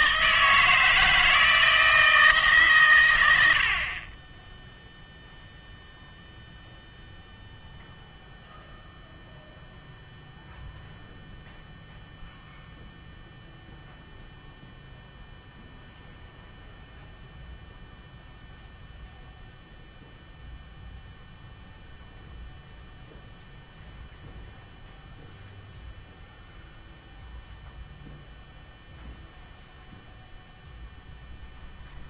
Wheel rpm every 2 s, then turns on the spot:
160, 140, 0, 0, 0, 0, 0, 0, 0, 0, 0, 0, 0, 0, 0, 0.
none